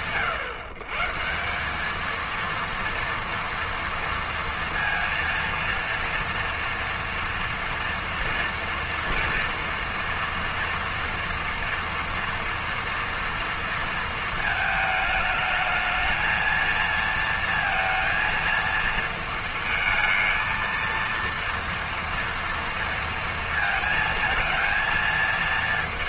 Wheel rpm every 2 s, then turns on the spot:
140, 230, 230, 230, 240, 230, 230, 220, 230, 230, 230, 230, 230.
none